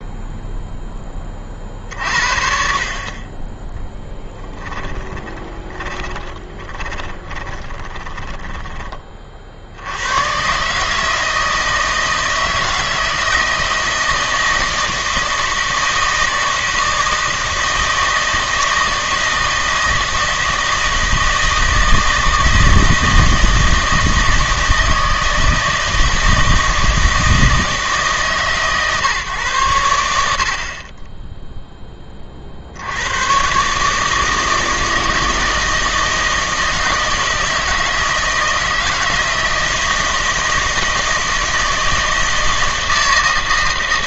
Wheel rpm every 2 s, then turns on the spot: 0, 50, 30, 30, 20, 140, 160, 160, 160, 160, 160, 160, 160, 160, 140, 50, 60, 160, 160, 160, 160, 160.
4-10